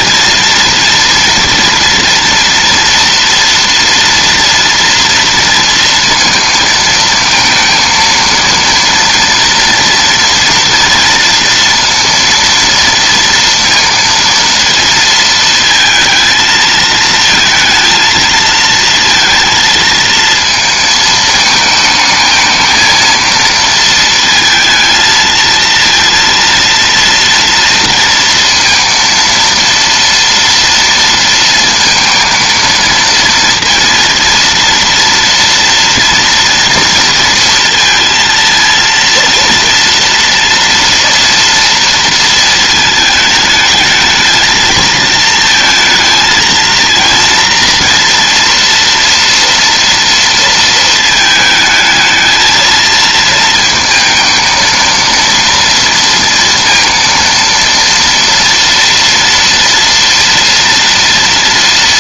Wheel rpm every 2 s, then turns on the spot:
230, 230, 230, 220, 230, 240, 230, 230, 220, 230, 220, 220, 220, 230, 230, 230, 230, 230, 230, 230, 230, 220, 220, 230, 230, 220, 220, 230, 230, 230, 230.
none